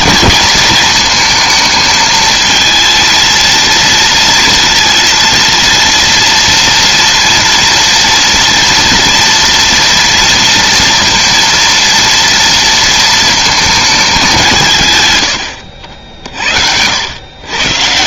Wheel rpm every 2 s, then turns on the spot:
230, 220, 230, 230, 230, 230, 230, 150, 70.
none